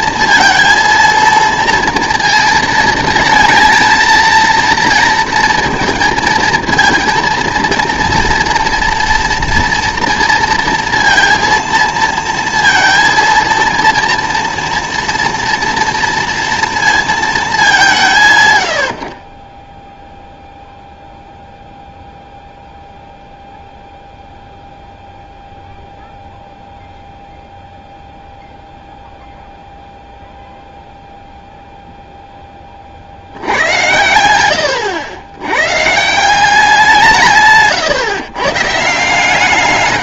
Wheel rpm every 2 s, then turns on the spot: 230, 230, 230, 220, 230, 230, 230, 230, 230, 120, 0, 0, 0, 0, 0, 0, 30, 100, 180, 140.
none